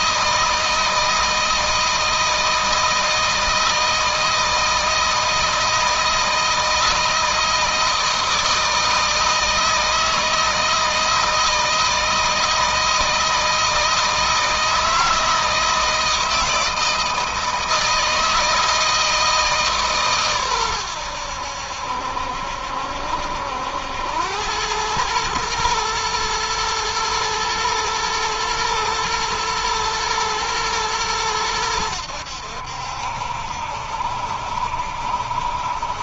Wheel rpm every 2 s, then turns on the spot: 160, 160, 160, 160, 160, 160, 160, 160, 160, 160, 100, 70, 110, 110, 120, 110, 70, 70.
none